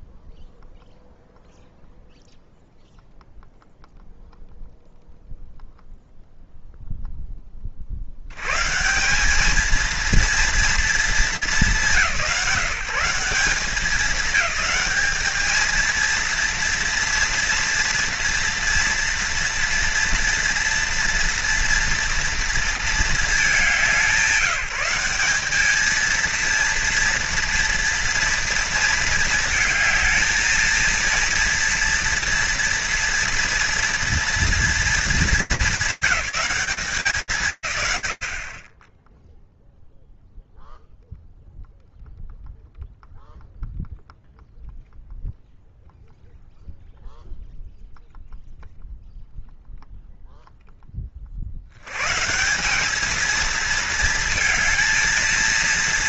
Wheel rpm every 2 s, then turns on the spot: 0, 0, 0, 0, 180, 200, 180, 200, 230, 230, 240, 220, 180, 230, 220, 230, 230, 230, 190, 20, 0, 0, 0, 0, 0, 30, 210, 220.
none